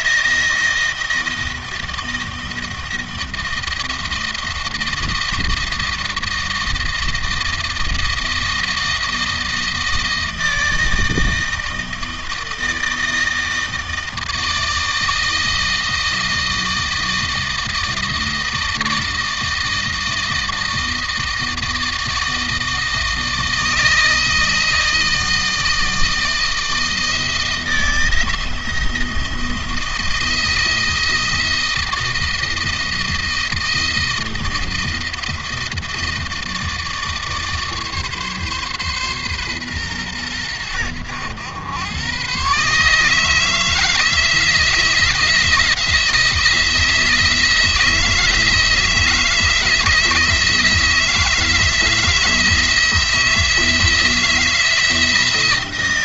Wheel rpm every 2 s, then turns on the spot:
170, 160, 160, 160, 160, 160, 160, 160, 160, 160, 160, 160, 160, 160, 160, 160, 160, 160, 160, 140, 100, 140, 160, 160, 160, 160, 160, 160.
none